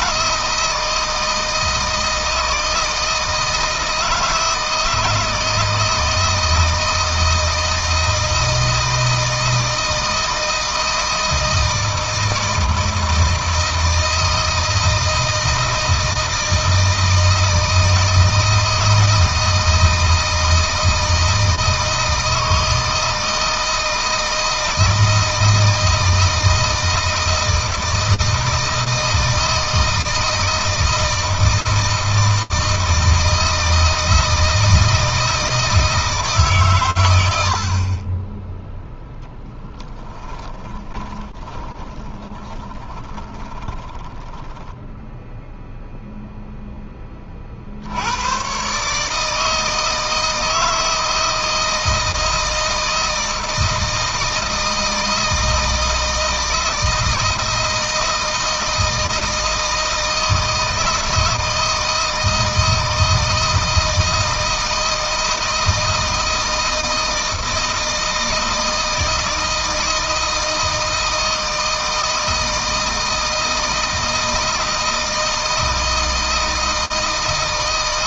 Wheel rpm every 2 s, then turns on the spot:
160, 160, 160, 160, 160, 160, 160, 160, 160, 160, 160, 160, 160, 160, 160, 160, 160, 160, 130, 0, 20, 20, 10, 10, 140, 160, 160, 160, 160, 160, 160, 160, 160, 160, 160, 160, 160, 160, 160.
40-44